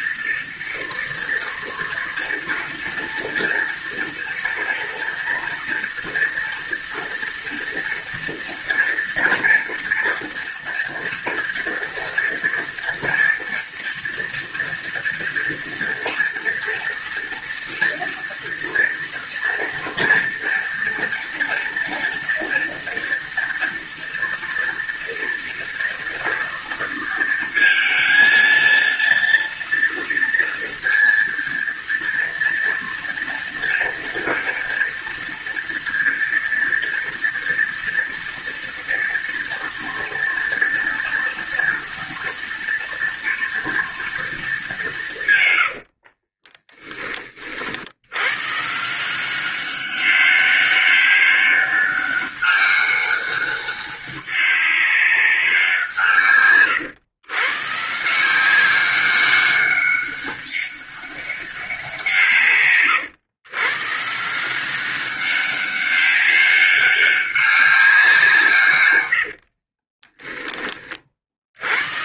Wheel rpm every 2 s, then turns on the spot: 230, 240, 230, 230, 230, 240, 230, 230, 230, 230, 230, 230, 230, 230, 230, 230, 230, 230, 230, 230, 230, 230, 180, 20, 160, 200, 200, 190, 120, 190, 200, 120, 190, 200, 110, 40.
68-70